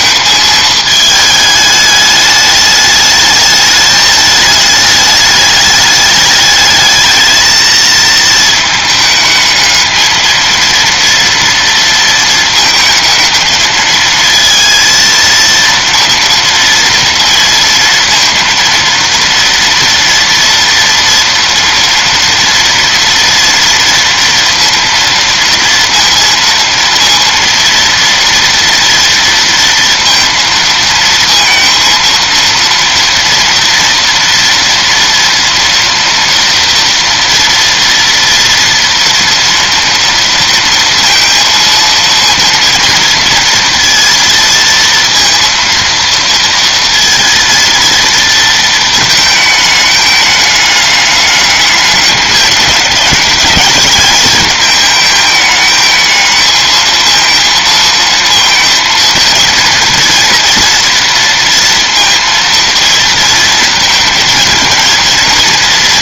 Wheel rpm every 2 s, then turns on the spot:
220, 210, 210, 210, 220, 230, 220, 230, 230, 230, 230, 230, 230, 230, 230, 230, 230, 230, 230, 230, 230, 230, 230, 230, 220, 210, 210, 220, 220, 230, 230, 230, 220.
none